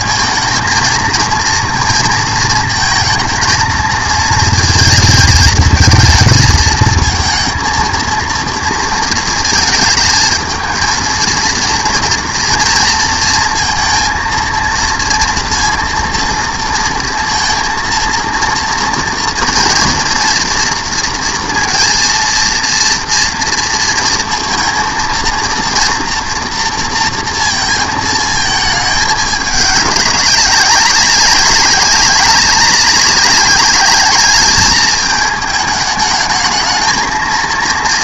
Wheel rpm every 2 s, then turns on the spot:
230, 220, 220, 220, 230, 220, 230, 230, 230, 230, 240, 230, 230, 230, 220, 190, 200, 210, 220.
none